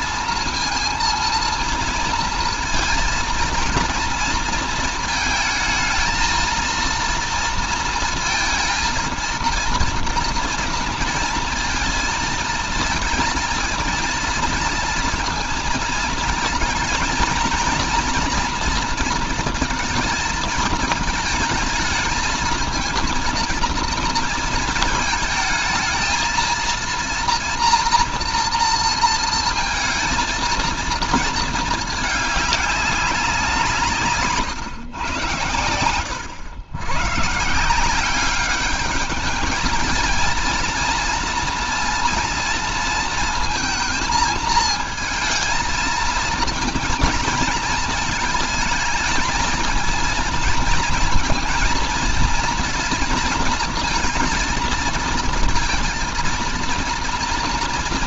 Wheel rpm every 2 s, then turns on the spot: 230, 230, 230, 230, 230, 230, 220, 230, 230, 230, 220, 220, 230, 230, 230, 230, 210, 140, 100, 200, 230, 230, 220, 220, 220, 230, 230, 230, 230.
none